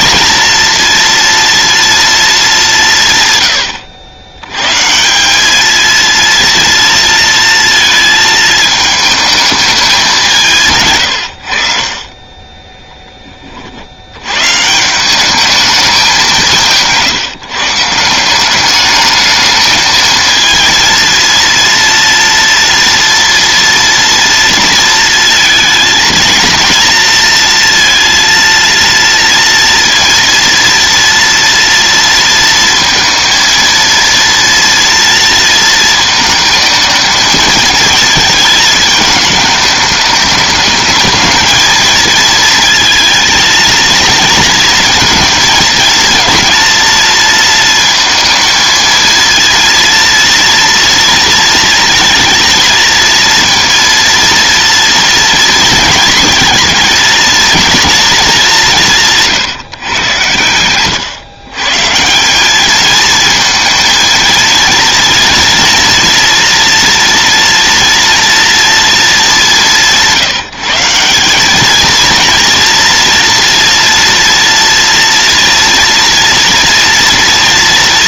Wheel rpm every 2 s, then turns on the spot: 230, 170, 140, 230, 220, 120, 10, 160, 150, 210, 230, 240, 230, 230, 230, 230, 230, 230, 220, 220, 220, 220, 230, 230, 230, 230, 230, 230, 230, 170, 120, 220, 230, 240, 220, 170, 230, 230, 230.
10-12